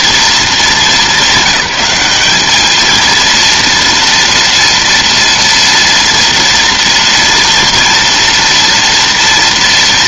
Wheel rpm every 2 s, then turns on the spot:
210, 220, 230, 230, 230.
none